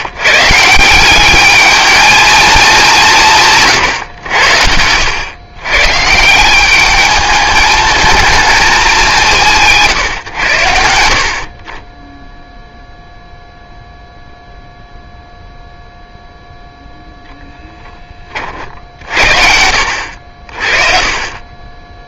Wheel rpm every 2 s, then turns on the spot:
150, 210, 90, 170, 220, 100, 0, 0, 0, 50, 60.
none